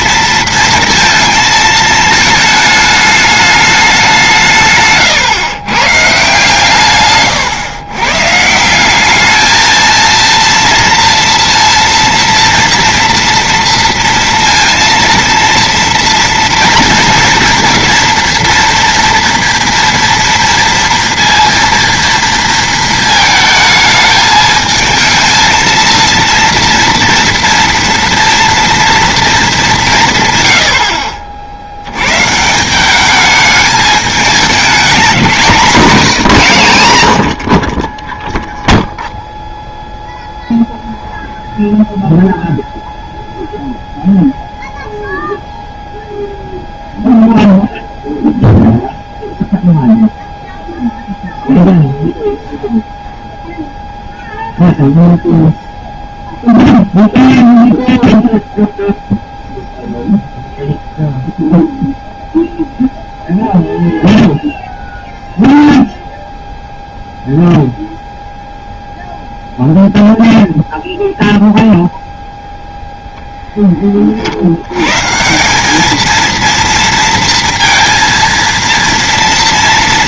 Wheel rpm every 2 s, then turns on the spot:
230, 220, 140, 140, 190, 230, 240, 230, 230, 230, 230, 220, 220, 230, 230, 70, 200, 200, 140, 0, 0, 0, 0, 0, 0, 0, 0, 0, 0, 0, 0, 0, 0, 0, 0, 0, 0, 90, 230, 230.
none